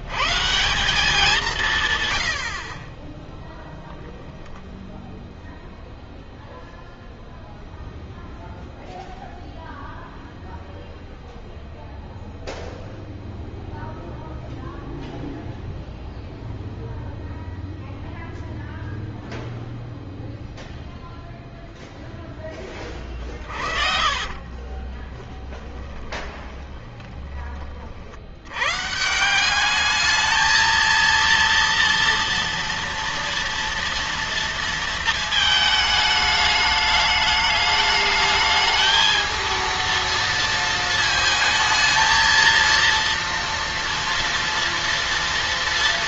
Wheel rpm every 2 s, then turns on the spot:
170, 40, 0, 0, 0, 0, 0, 0, 0, 0, 0, 30, 30, 20, 140, 230, 230, 230, 210, 220, 220, 230, 230.
22-28